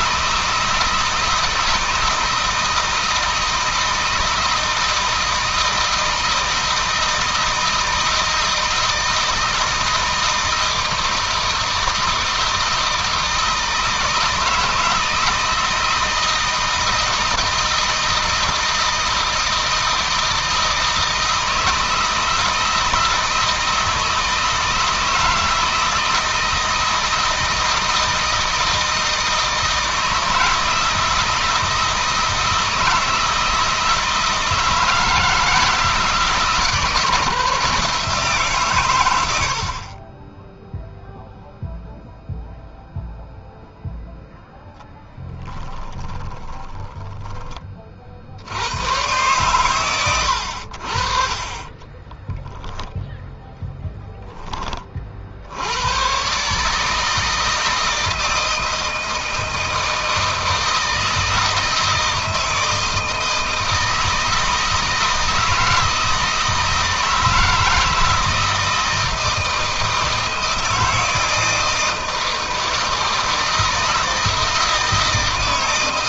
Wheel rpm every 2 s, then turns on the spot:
160, 160, 160, 160, 160, 160, 160, 160, 160, 170, 160, 160, 160, 160, 160, 160, 160, 160, 160, 110, 0, 0, 10, 10, 100, 60, 0, 30, 150, 160, 160, 160, 160, 160, 160, 160, 160, 160.
46-48